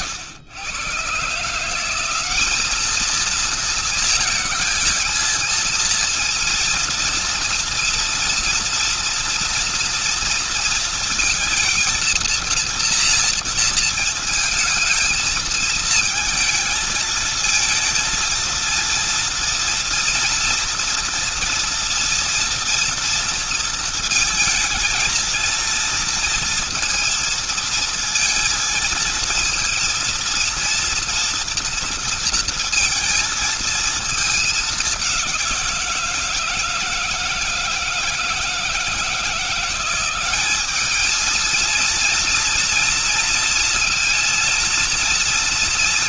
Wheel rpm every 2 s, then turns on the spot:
110, 200, 230, 230, 230, 230, 230, 220, 220, 230, 230, 230, 220, 230, 230, 230, 230, 210, 160, 160, 200, 230, 230.
none